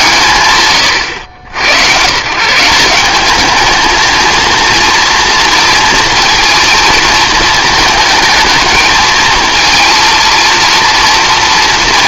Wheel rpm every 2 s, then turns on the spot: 120, 180, 230, 230, 220, 230.
none